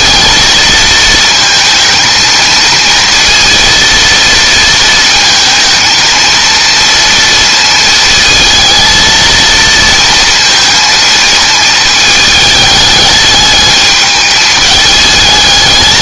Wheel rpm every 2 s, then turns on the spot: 220, 230, 230, 230, 230, 230, 210, 210.
none